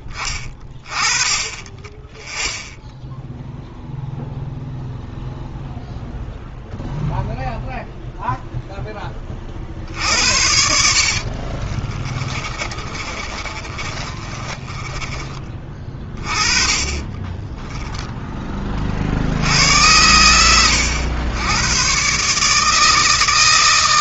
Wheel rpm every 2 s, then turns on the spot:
20, 10, 0, 0, 0, 60, 30, 30, 30, 20, 100, 150.
12-16